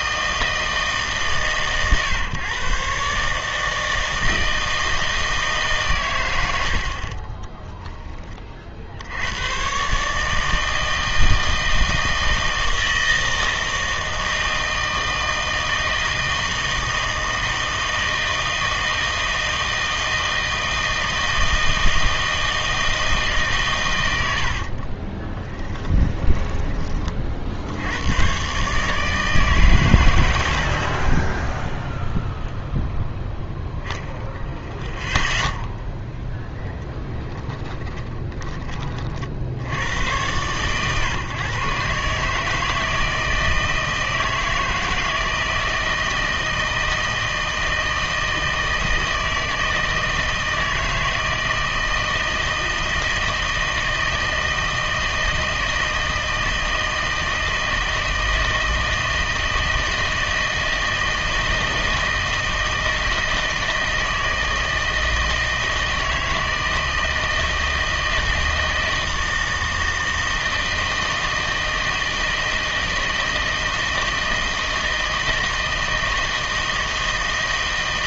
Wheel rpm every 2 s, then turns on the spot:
160, 130, 160, 70, 50, 160, 160, 160, 160, 160, 160, 160, 50, 20, 140, 50, 0, 0, 0, 20, 120, 160, 160, 160, 160, 160, 160, 160, 160, 160, 160, 160, 160, 160, 160, 160, 160, 160, 160.
6-8 24-26 30-32